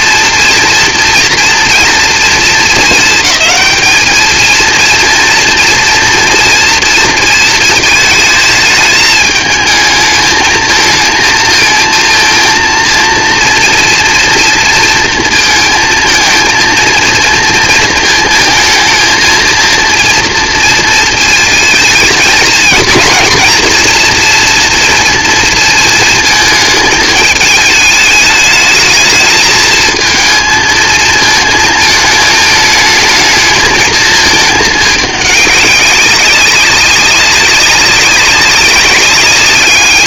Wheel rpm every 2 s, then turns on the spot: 230, 220, 230, 230, 210, 220, 230, 230, 230, 220, 230, 220, 230, 220, 220, 220, 220, 210, 190, 200.
none